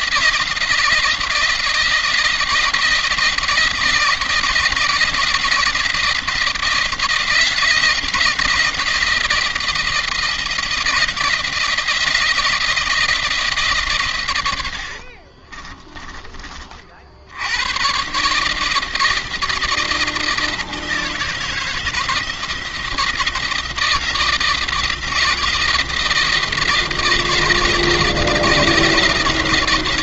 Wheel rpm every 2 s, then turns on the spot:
170, 160, 170, 160, 170, 160, 160, 90, 40, 160, 160, 170, 170, 170, 170.
14-16